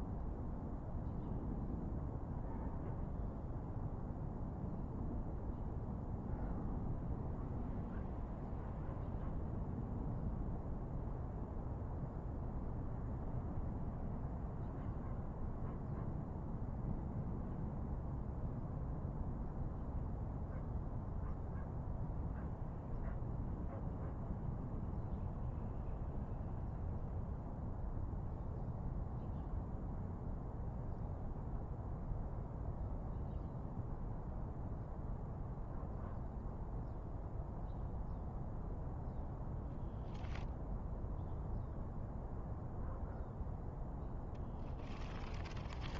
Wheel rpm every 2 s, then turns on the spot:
0, 0, 0, 0, 0, 0, 0, 0, 0, 0, 0, 0, 0, 0, 0, 0, 0, 0, 0, 0, 0, 0, 0.
none